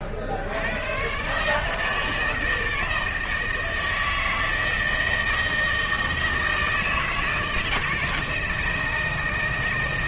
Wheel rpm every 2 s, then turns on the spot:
100, 160, 160, 160, 160.
none